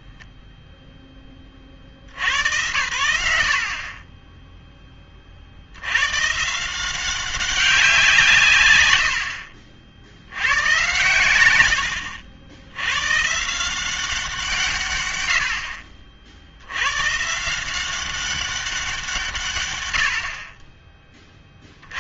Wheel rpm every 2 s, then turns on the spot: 0, 120, 10, 160, 120, 110, 100, 160, 70, 190, 10.
none